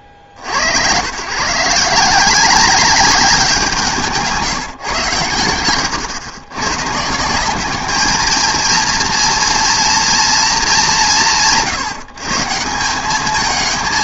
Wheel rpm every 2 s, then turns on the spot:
70, 190, 170, 120, 230, 190, 170.
none